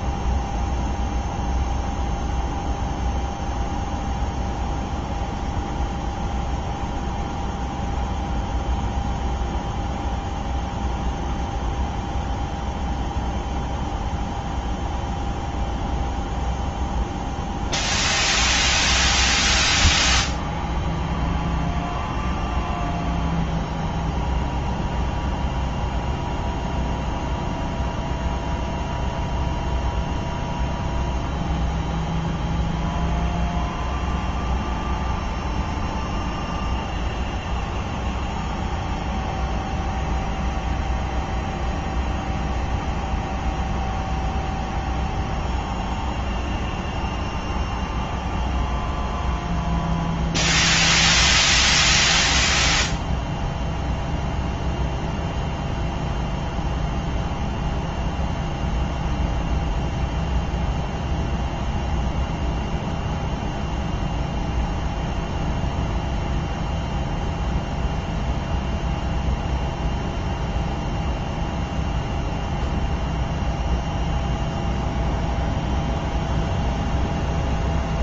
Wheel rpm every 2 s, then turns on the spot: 0, 0, 0, 0, 0, 0, 0, 0, 0, 0, 0, 0, 0, 0, 0, 0, 0, 0, 0, 0, 0, 0, 0, 0, 0, 0, 0, 0, 0, 0, 0, 0, 0, 0, 0, 0, 0, 0, 0.
none